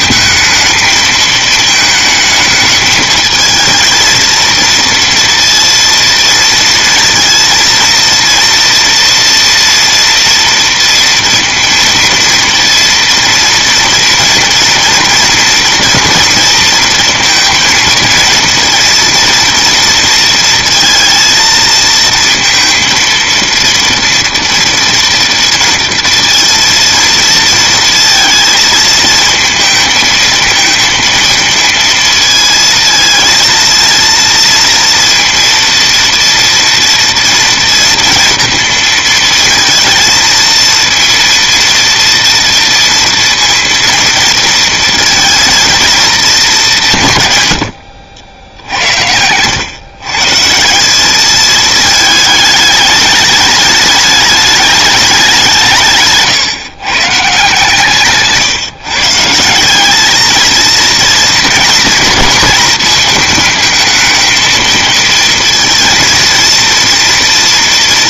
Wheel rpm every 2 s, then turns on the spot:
210, 220, 230, 230, 230, 230, 230, 230, 230, 230, 230, 230, 230, 230, 220, 230, 220, 230, 230, 230, 230, 230, 230, 180, 70, 160, 210, 210, 130, 140, 230, 220, 230, 230.
none